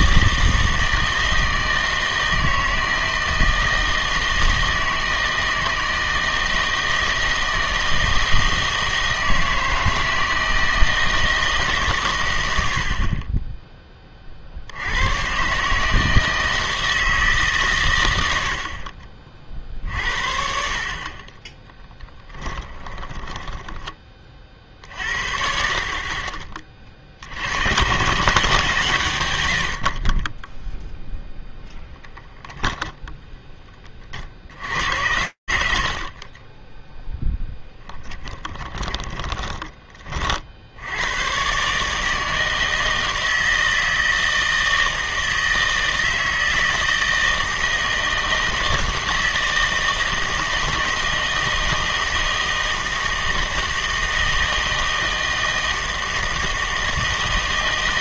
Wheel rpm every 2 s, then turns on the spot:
160, 160, 160, 160, 160, 160, 90, 60, 160, 80, 50, 10, 40, 30, 150, 10, 0, 60, 10, 20, 80, 160, 160, 160, 160, 160, 160, 160, 160.
22-24 34-40